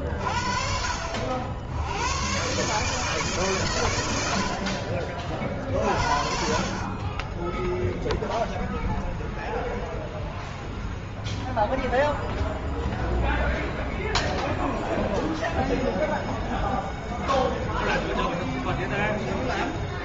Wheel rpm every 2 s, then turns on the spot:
50, 120, 70, 40, 0, 0, 0, 0, 0, 0.
none